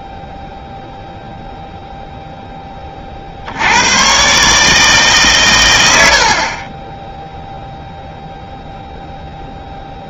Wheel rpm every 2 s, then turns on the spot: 0, 0, 100, 100, 0.
none